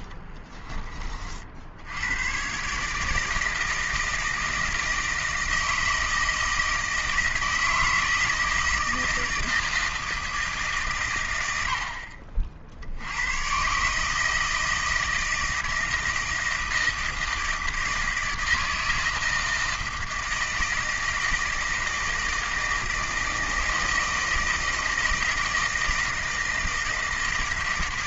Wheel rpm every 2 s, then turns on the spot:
30, 130, 160, 160, 160, 150, 70, 160, 160, 160, 160, 160, 160, 160.
0-2